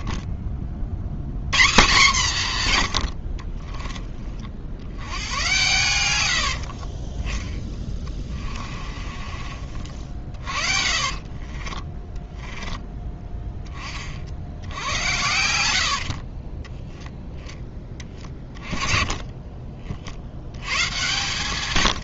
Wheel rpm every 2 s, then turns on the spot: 120, 60, 80, 80, 30, 40, 10, 80, 10, 30, 120.
6-12